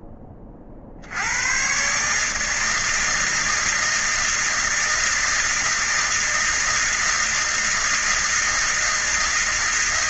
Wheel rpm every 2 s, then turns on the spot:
20, 150, 160, 160, 160.
none